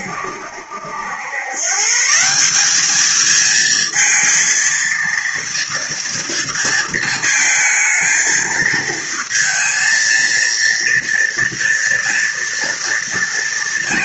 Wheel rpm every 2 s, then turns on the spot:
80, 210, 230, 230, 220, 230, 230.
none